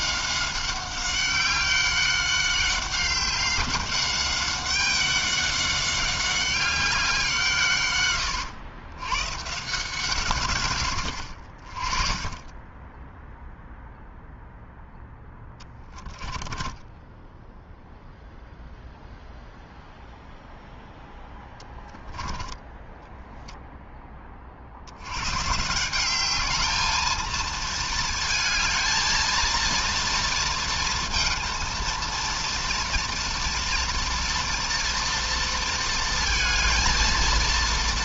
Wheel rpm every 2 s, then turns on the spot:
190, 190, 200, 190, 120, 120, 20, 0, 10, 0, 0, 10, 30, 210, 220, 230, 230, 240, 230.
16-18 22-24